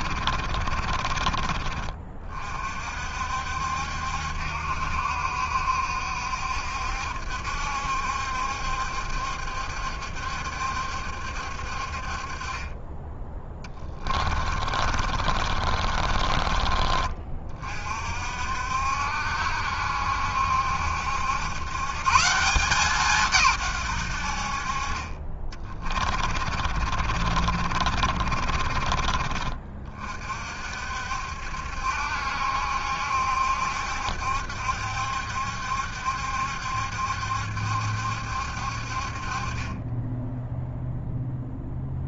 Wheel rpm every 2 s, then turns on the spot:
50, 50, 70, 70, 70, 70, 20, 50, 40, 70, 70, 170, 40, 40, 40, 60, 70, 70, 70, 60, 0.
0-2 14-16 26-30